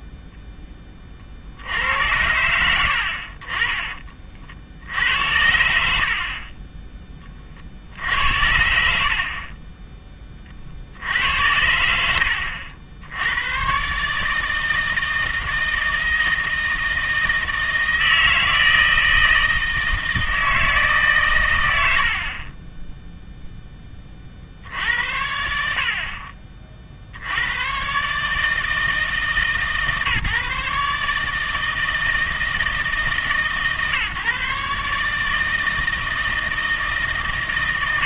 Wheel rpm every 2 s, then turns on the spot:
10, 80, 70, 20, 90, 50, 80, 160, 160, 160, 160, 10, 70, 40, 160, 150, 160, 140, 160.
22-24